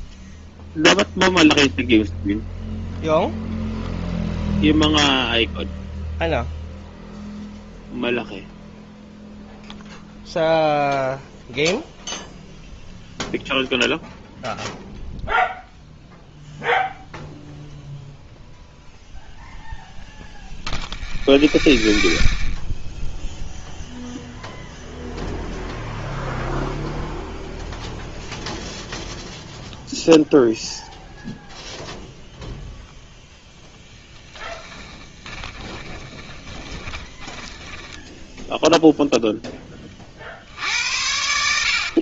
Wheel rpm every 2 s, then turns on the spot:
0, 0, 0, 0, 0, 0, 0, 0, 0, 0, 0, 0, 0, 0, 0, 0, 0, 10, 20, 10, 80.
34-38